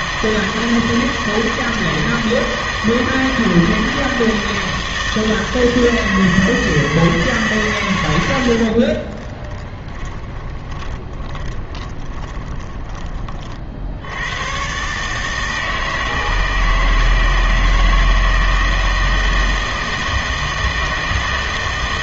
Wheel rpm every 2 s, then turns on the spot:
160, 160, 160, 160, 80, 20, 20, 110, 160, 170, 160.
8-14